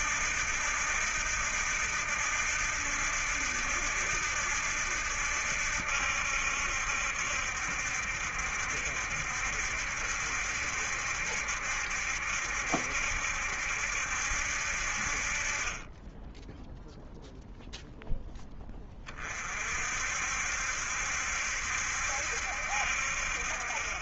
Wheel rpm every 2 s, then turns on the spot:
80, 80, 80, 70, 70, 70, 70, 60, 10, 10, 60, 60.
none